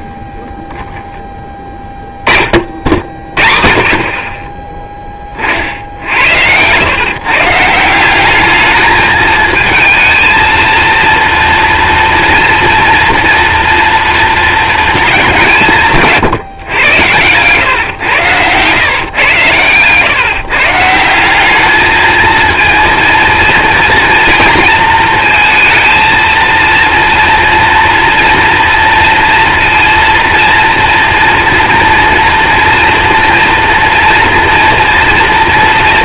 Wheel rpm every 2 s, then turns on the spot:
20, 60, 10, 120, 220, 230, 230, 220, 110, 130, 180, 230, 230, 230, 230, 230, 240, 230.
18-20